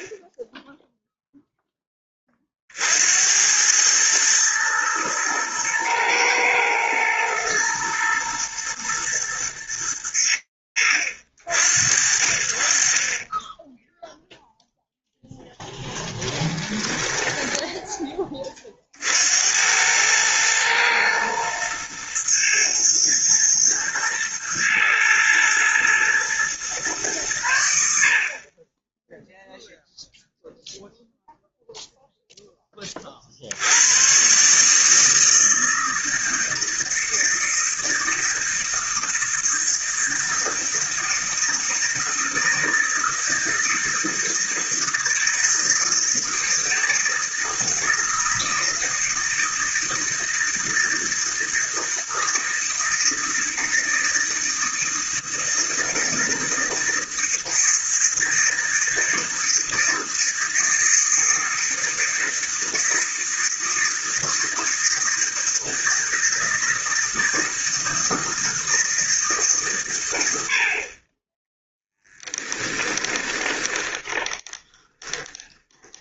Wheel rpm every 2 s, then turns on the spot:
10, 50, 110, 120, 110, 70, 20, 0, 10, 70, 110, 110, 110, 100, 0, 0, 50, 160, 160, 160, 160, 160, 160, 160, 160, 160, 160, 160, 160, 160, 160, 160, 160, 160, 150, 10, 20, 20.
16-18 72-76